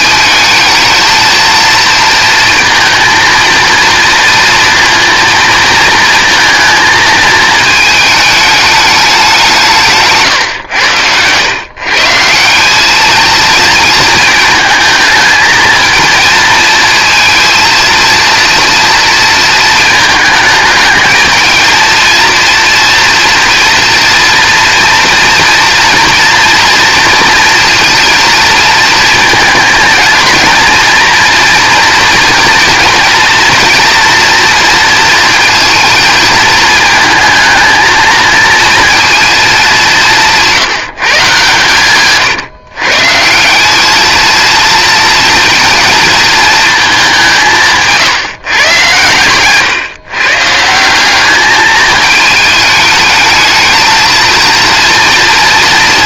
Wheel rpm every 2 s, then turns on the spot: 230, 230, 230, 220, 210, 110, 210, 220, 230, 230, 220, 230, 230, 230, 230, 230, 230, 230, 230, 230, 160, 140, 230, 200, 120, 190, 210, 230.
10-12